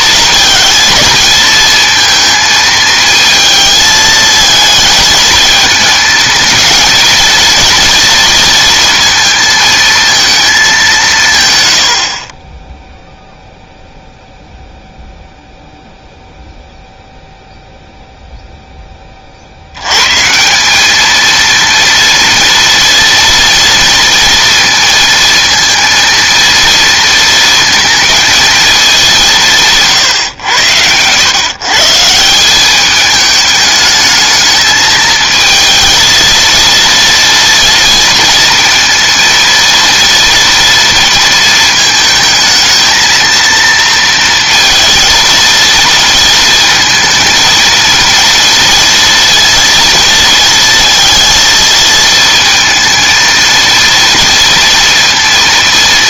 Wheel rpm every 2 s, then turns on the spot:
220, 220, 220, 220, 220, 200, 10, 0, 0, 10, 200, 230, 230, 230, 220, 100, 200, 220, 230, 230, 230, 220, 230, 230, 230, 230, 220, 230.
none